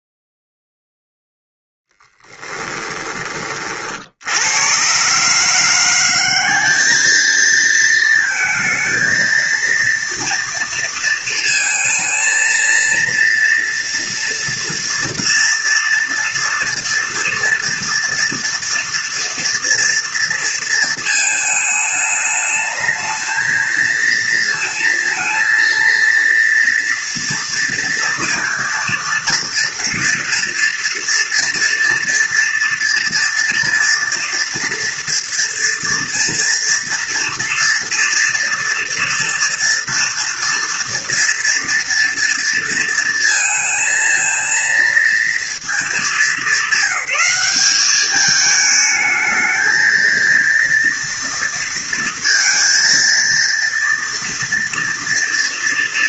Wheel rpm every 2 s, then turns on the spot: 0, 10, 110, 200, 220, 230, 230, 230, 230, 230, 230, 220, 230, 230, 230, 240, 230, 230, 230, 230, 230, 230, 230, 190, 210, 230, 230, 230.
2-4